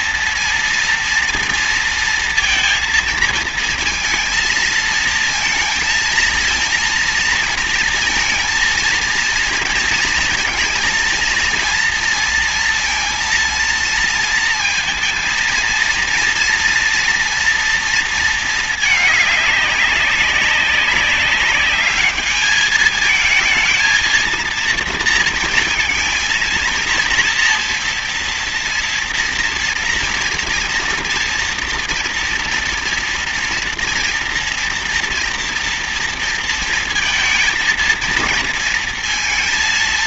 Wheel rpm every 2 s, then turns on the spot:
230, 230, 220, 230, 230, 230, 230, 230, 230, 210, 200, 210, 230, 230, 230, 230, 230, 230, 230, 230.
none